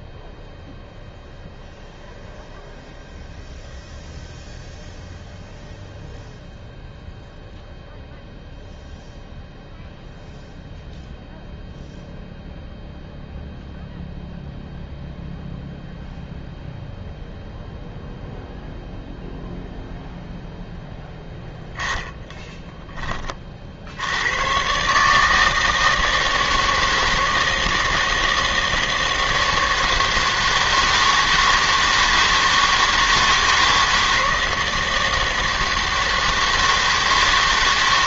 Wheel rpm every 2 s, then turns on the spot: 0, 0, 0, 0, 0, 0, 0, 0, 0, 0, 0, 10, 120, 160, 160, 160, 160, 160, 160.
none